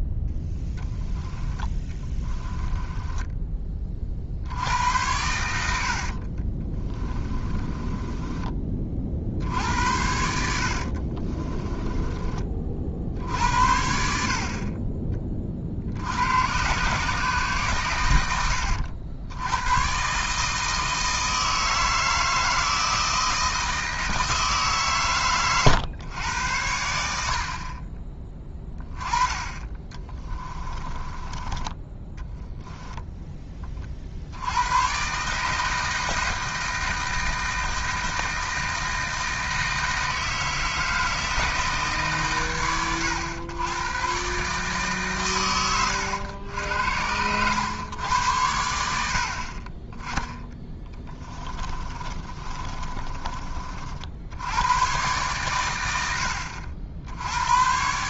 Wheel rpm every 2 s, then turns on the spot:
10, 10, 80, 20, 30, 60, 50, 40, 130, 90, 160, 160, 140, 80, 10, 20, 10, 110, 160, 160, 160, 110, 140, 80, 80, 20, 30, 110, 70.
2-4 6-8 10-12 30-32 50-54